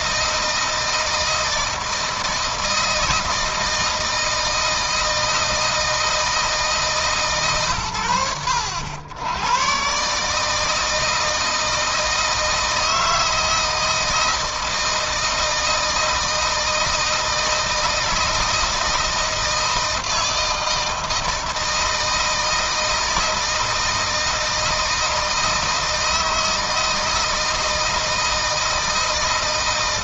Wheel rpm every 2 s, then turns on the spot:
160, 160, 160, 150, 80, 160, 160, 160, 160, 160, 160, 160, 160, 160, 160.
none